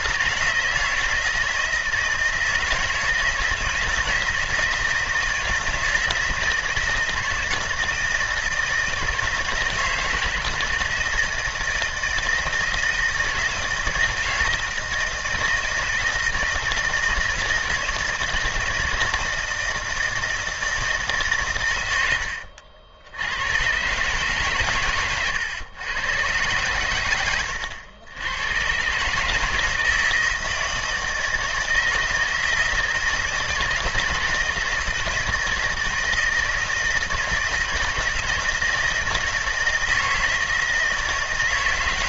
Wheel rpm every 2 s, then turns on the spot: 160, 160, 160, 160, 160, 160, 160, 160, 160, 160, 160, 80, 120, 100, 120, 160, 160, 160, 160, 160, 150.
none